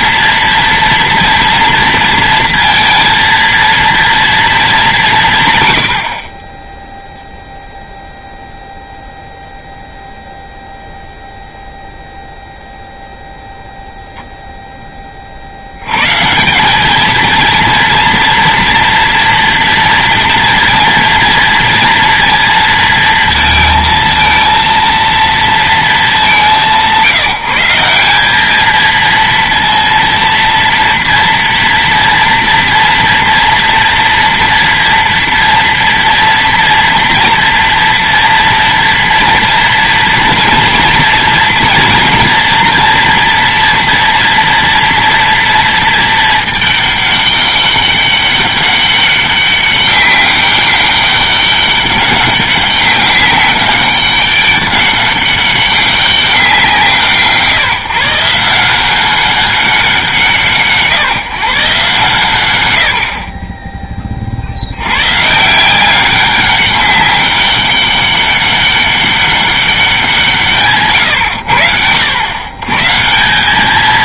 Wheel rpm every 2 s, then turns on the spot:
240, 230, 200, 10, 0, 0, 0, 10, 200, 230, 230, 230, 230, 170, 220, 230, 240, 230, 230, 230, 230, 230, 230, 210, 200, 200, 190, 200, 170, 180, 150, 90, 90, 200, 200, 140, 140.
none